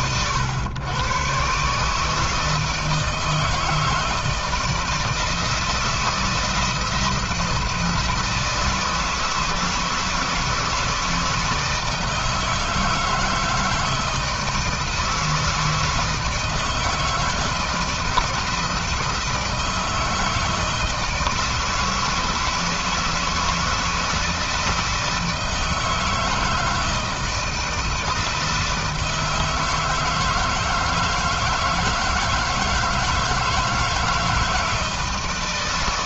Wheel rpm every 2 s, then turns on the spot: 120, 160, 160, 170, 160, 160, 160, 160, 160, 160, 160, 160, 160, 160, 160, 160, 160, 160.
none